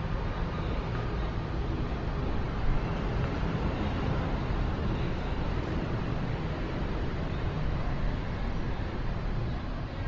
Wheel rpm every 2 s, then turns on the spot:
0, 0, 0, 0, 0.
none